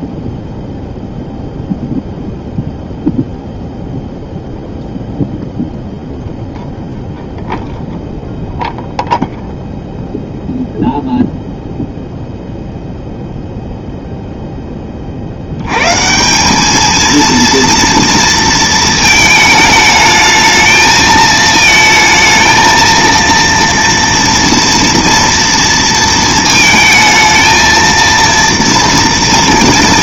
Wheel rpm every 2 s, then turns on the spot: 0, 0, 0, 0, 0, 0, 0, 10, 210, 230, 220, 220, 230, 220, 230.
none